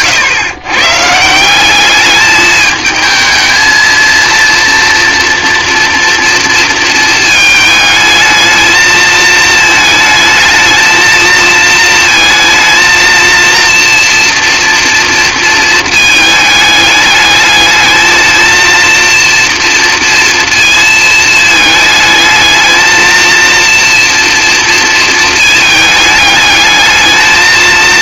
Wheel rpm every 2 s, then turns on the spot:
130, 220, 230, 230, 220, 220, 230, 240, 210, 230, 230, 220, 230, 210.
none